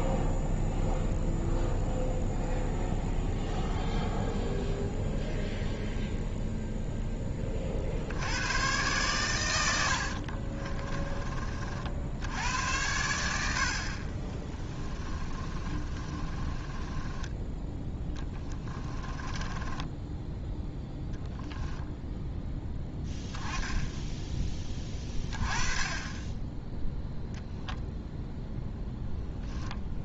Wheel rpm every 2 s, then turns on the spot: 0, 0, 0, 0, 120, 30, 80, 20, 20, 10, 10, 10, 20, 0, 0.
10-12 14-20